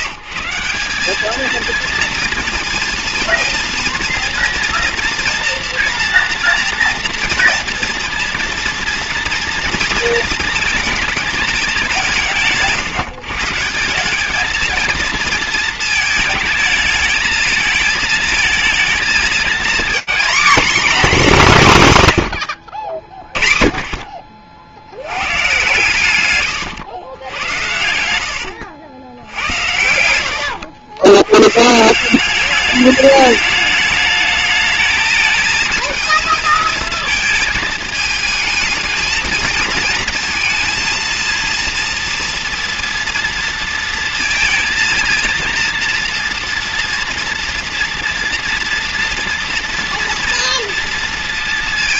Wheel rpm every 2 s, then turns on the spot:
170, 230, 230, 240, 230, 220, 160, 220, 220, 220, 250, 80, 60, 110, 100, 100, 210, 220, 220, 220, 230, 230, 230, 240, 230, 230.
26-30